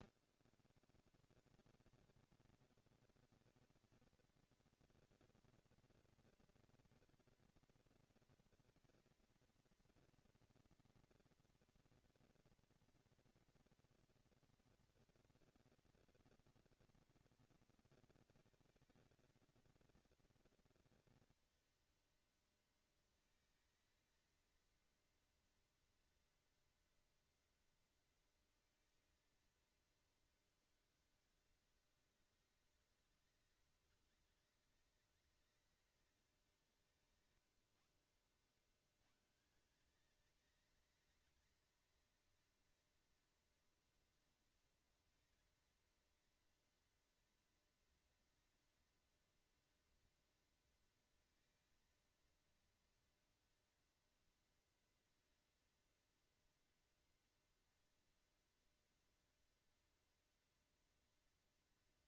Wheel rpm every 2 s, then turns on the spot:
130, 220, 240, 230, 230, 230, 230, 230, 230, 220, 220, 220, 230, 230, 230, 200, 190, 190, 170, 150, 220, 230, 230, 230, 230, 230, 230, 230, 230, 230, 230.
none